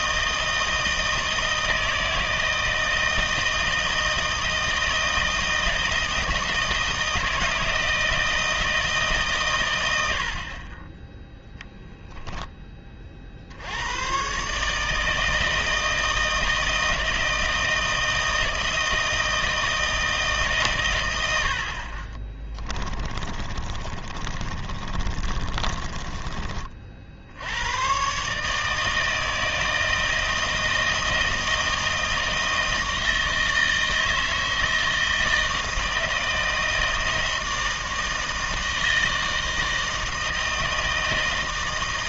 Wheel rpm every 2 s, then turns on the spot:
160, 160, 160, 160, 160, 20, 20, 150, 160, 160, 130, 20, 30, 40, 150, 160, 160, 160, 160, 160, 160.
22-26